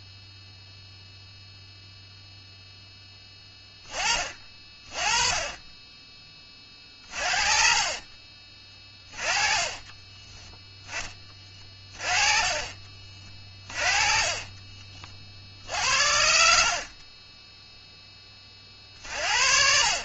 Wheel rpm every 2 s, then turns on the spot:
10, 20, 40, 30, 30, 40, 50, 20, 50, 40.
4-8 10-12 14-16 18-20